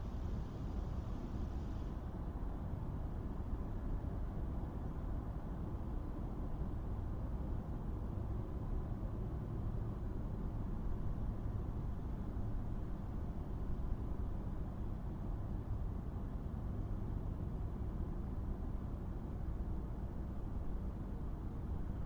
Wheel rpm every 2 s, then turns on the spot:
0, 0, 0, 0, 0, 0, 0, 0, 0, 0, 0.
none